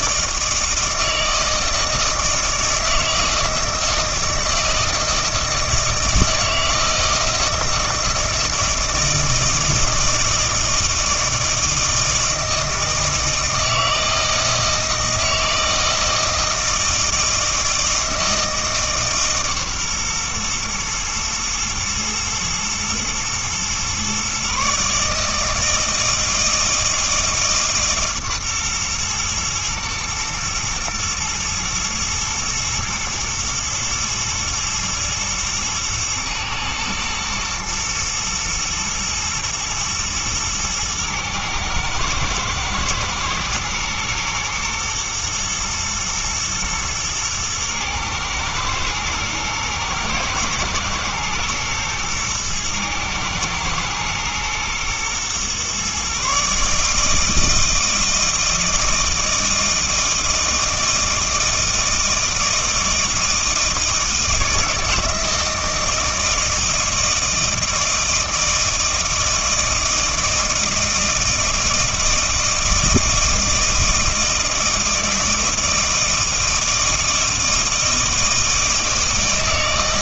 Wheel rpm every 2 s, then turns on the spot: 160, 160, 160, 160, 160, 160, 160, 160, 160, 160, 120, 110, 140, 160, 130, 110, 110, 110, 110, 120, 110, 120, 120, 120, 110, 120, 110, 110, 150, 160, 160, 160, 160, 160, 160, 160, 160, 160, 160, 160.
none